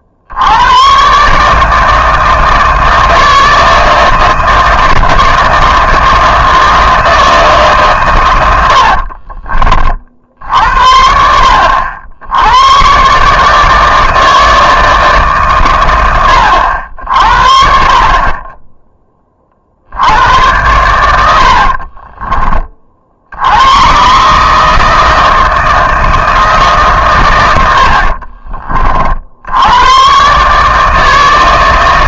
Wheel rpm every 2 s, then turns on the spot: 100, 160, 160, 160, 90, 60, 110, 160, 80, 20, 100, 30, 150, 150, 30, 150.
8-10